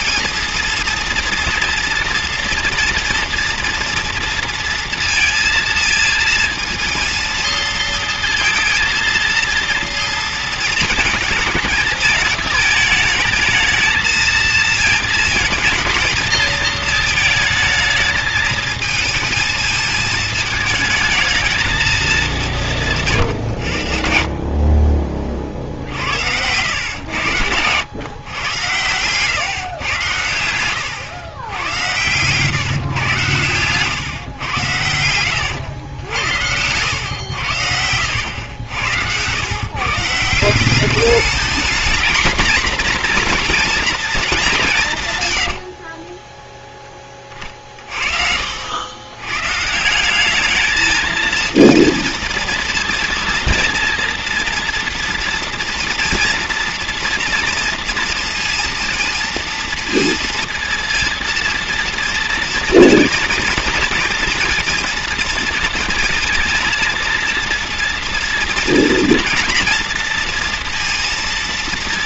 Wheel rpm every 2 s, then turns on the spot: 230, 230, 230, 230, 230, 220, 220, 220, 220, 220, 220, 180, 50, 110, 120, 110, 130, 110, 100, 90, 180, 230, 190, 10, 70, 210, 230, 230, 230, 230, 230, 230, 230, 230, 230, 240.
38-40